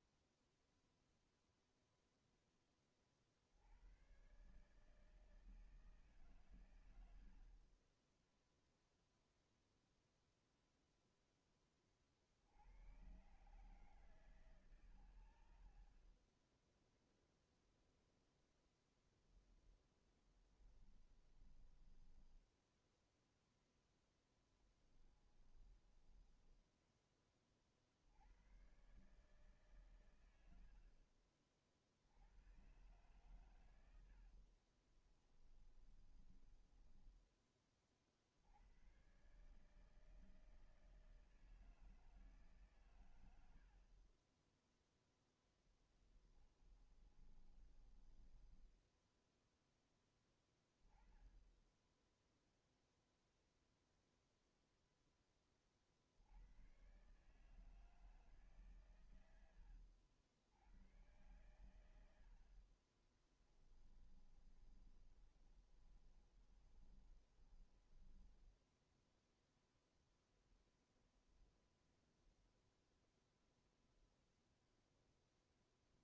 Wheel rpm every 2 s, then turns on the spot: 0, 40, 160, 60, 0, 40, 140, 30, 0, 10, 20, 0, 20, 30, 140, 60, 120, 20, 20, 130, 160, 100, 10, 30, 10, 10, 0, 10, 110, 120, 100, 30, 20, 20, 10, 0, 0, 0.
18-22 24-26 32-36 44-48 62-70